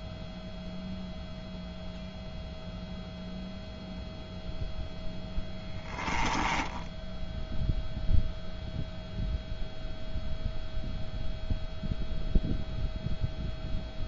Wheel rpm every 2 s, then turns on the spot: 0, 0, 0, 10, 0, 0, 0.
6-8